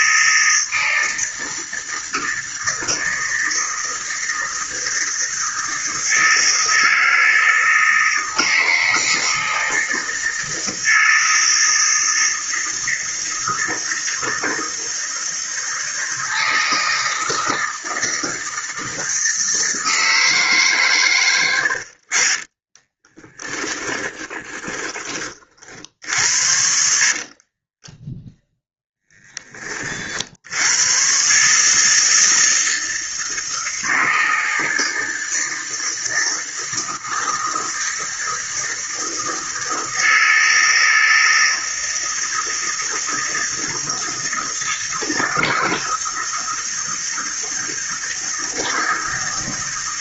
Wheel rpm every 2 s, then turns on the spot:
160, 160, 160, 160, 160, 160, 160, 160, 160, 160, 120, 20, 30, 50, 10, 130, 160, 160, 160, 160, 160, 160, 160, 160, 160.
22-24 26-28